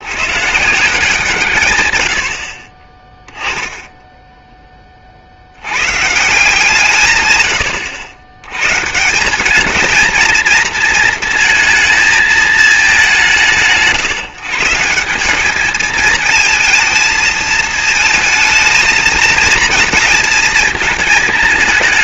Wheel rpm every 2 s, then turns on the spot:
180, 20, 40, 150, 150, 220, 180, 170, 220, 230, 220.
none